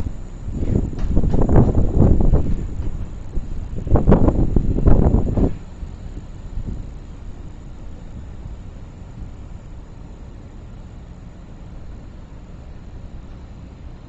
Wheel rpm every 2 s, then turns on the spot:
0, 0, 0, 0, 0, 0, 0.
none